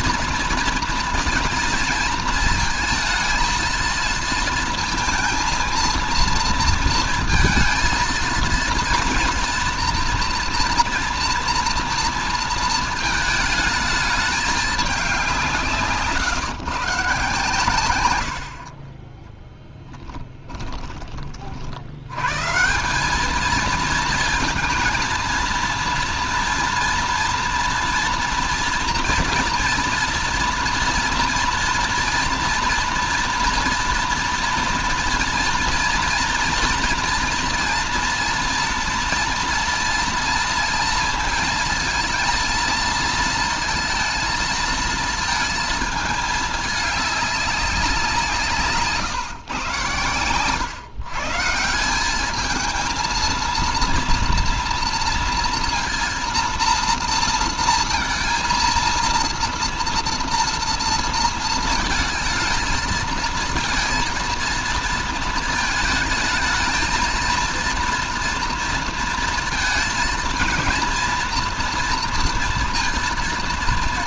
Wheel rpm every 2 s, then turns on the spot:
230, 230, 230, 230, 230, 240, 220, 200, 140, 40, 20, 180, 230, 240, 230, 240, 230, 230, 230, 230, 230, 230, 230, 210, 150, 130, 220, 230, 230, 230, 230, 220, 230, 230, 230, 230, 230.
none